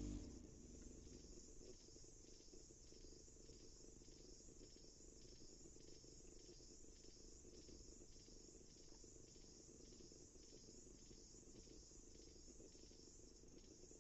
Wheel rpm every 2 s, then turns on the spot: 0, 0, 0, 0, 0, 0, 0.
none